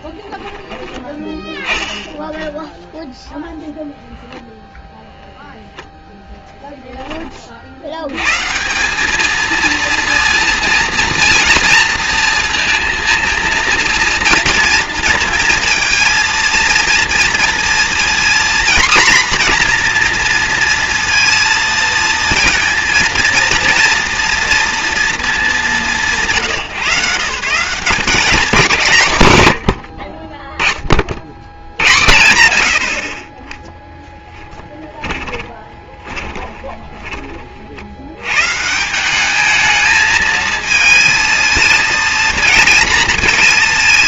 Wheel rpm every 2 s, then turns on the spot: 10, 0, 0, 10, 180, 230, 230, 230, 230, 240, 230, 230, 240, 140, 170, 20, 90, 10, 20, 150, 220, 230.
34-38